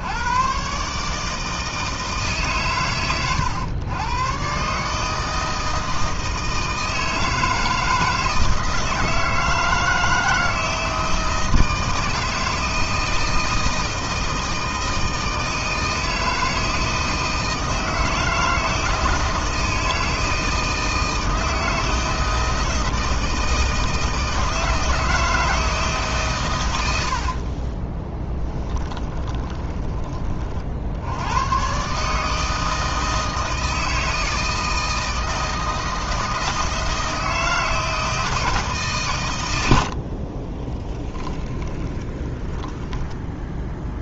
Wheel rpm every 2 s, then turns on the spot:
140, 120, 140, 160, 160, 160, 160, 160, 160, 160, 160, 160, 160, 100, 20, 60, 160, 160, 160, 140, 20, 10.
26-30 40-42